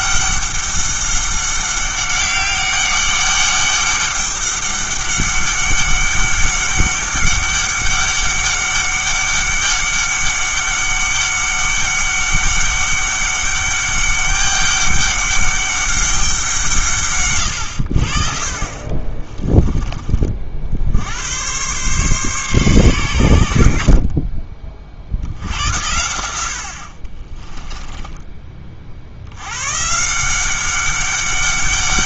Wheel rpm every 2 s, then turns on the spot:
200, 200, 200, 200, 200, 200, 200, 200, 160, 40, 60, 130, 40, 80, 30, 190.
18-20